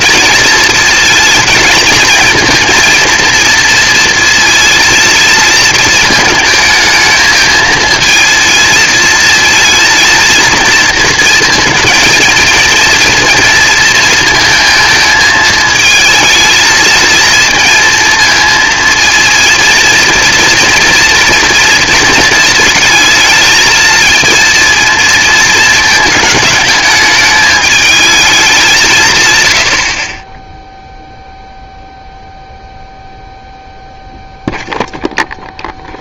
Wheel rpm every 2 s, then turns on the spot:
230, 230, 230, 220, 220, 230, 230, 220, 220, 230, 230, 220, 230, 220, 160, 0, 0, 0.
none